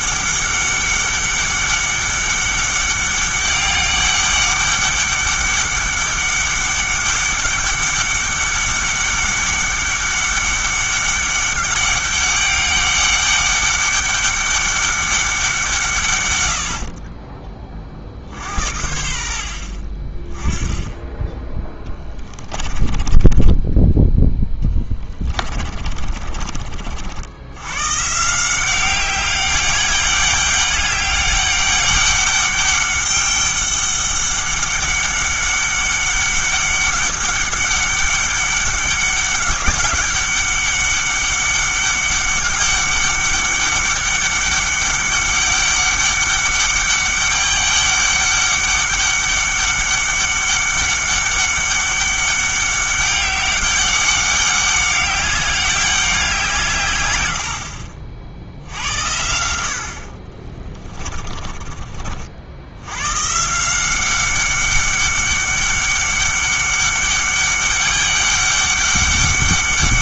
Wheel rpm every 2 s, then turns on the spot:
200, 200, 200, 200, 200, 200, 200, 200, 70, 80, 20, 20, 20, 40, 180, 200, 200, 200, 200, 200, 200, 200, 200, 200, 200, 200, 200, 190, 150, 70, 30, 80, 190, 200, 200.
22-26 60-62